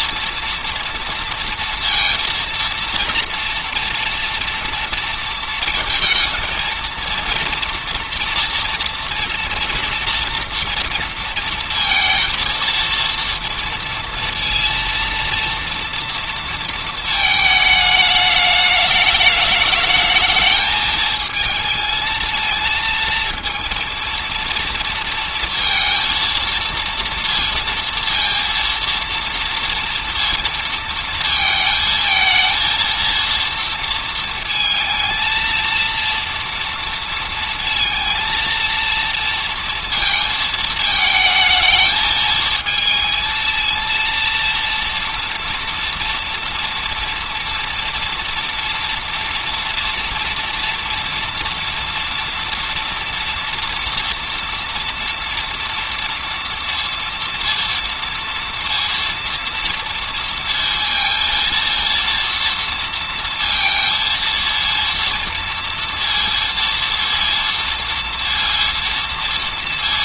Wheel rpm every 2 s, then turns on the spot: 230, 230, 230, 230, 230, 230, 230, 230, 230, 210, 220, 230, 230, 230, 230, 230, 230, 230, 230, 230, 220, 220, 230, 230, 230, 230, 230, 230, 230, 230, 230, 230, 230, 230, 230.
none